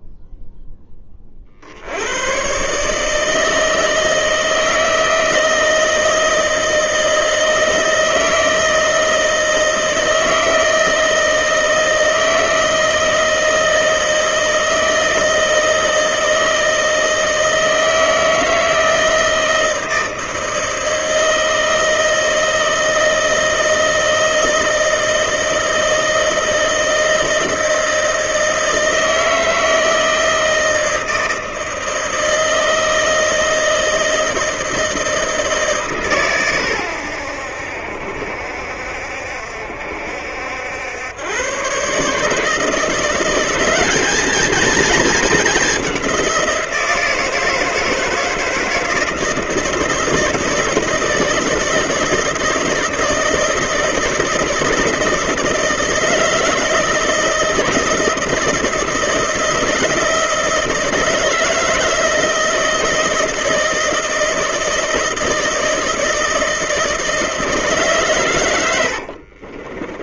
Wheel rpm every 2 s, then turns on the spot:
0, 130, 160, 160, 160, 160, 160, 160, 160, 160, 160, 160, 160, 160, 160, 160, 160, 160, 120, 70, 80, 160, 220, 180, 160, 160, 160, 160, 160, 170, 170, 160, 160, 160, 100.
none